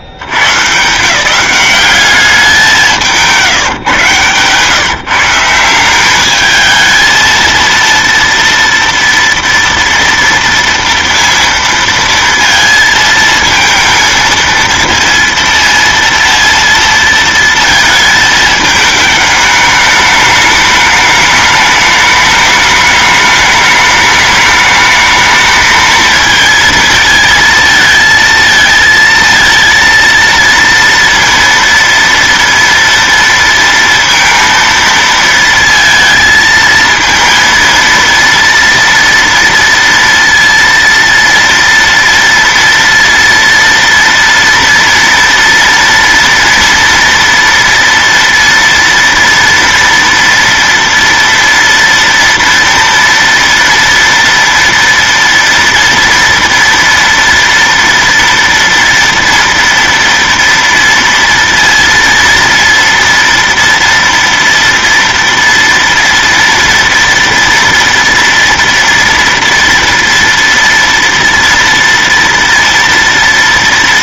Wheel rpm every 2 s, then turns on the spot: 90, 180, 140, 210, 230, 230, 230, 230, 230, 220, 210, 210, 210, 230, 230, 230, 230, 230, 220, 230, 230, 230, 230, 230, 230, 230, 230, 230, 230, 240, 230, 230, 230, 230, 230, 230, 230.
none